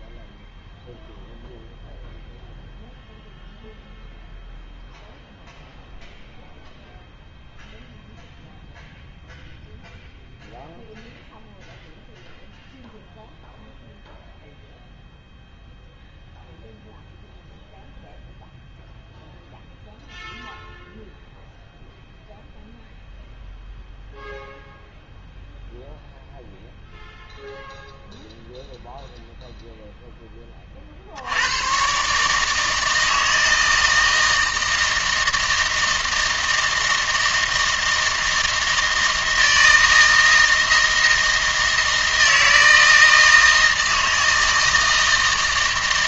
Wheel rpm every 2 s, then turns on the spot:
0, 0, 0, 0, 0, 0, 0, 0, 0, 0, 0, 0, 0, 0, 0, 30, 160, 160, 160, 160, 160, 160, 160.
none